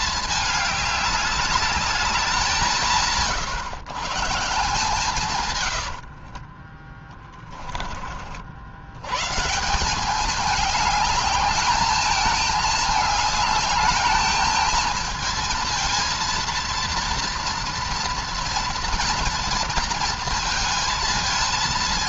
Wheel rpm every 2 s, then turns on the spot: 210, 170, 150, 30, 80, 210, 210, 220, 230, 240, 230.
6-8